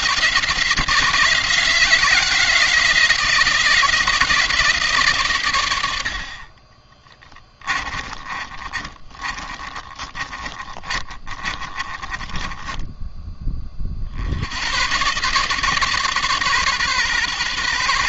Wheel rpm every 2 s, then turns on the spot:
160, 170, 150, 20, 30, 30, 20, 110, 130.
6-14